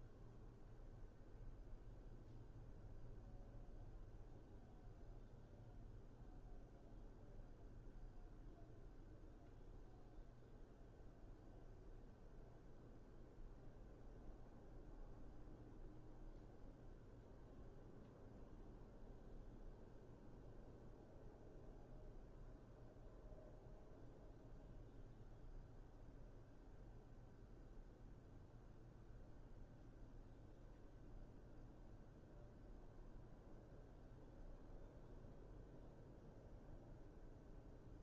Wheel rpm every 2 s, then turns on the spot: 0, 0, 0, 0, 0, 0, 0, 0, 0, 0, 0, 0, 0, 0, 0, 0, 0, 0, 0.
none